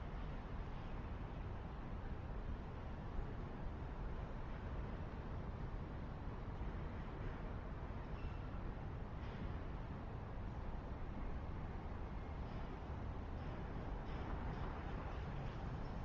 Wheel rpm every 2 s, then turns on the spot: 0, 0, 0, 0, 0, 0, 0, 0.
none